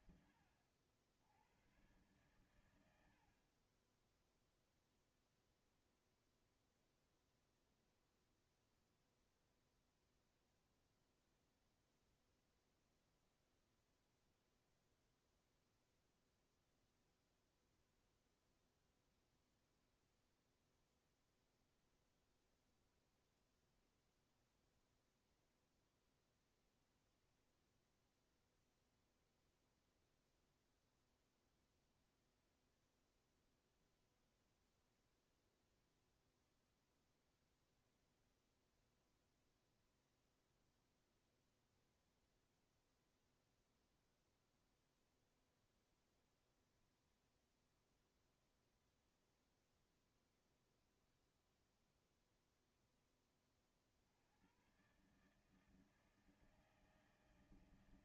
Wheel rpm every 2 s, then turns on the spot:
90, 90, 0, 0, 0, 0, 0, 0, 0, 0, 0, 0, 0, 0, 0, 0, 0, 0, 0, 0, 0, 0, 0, 0, 0, 0, 10, 120, 160.
none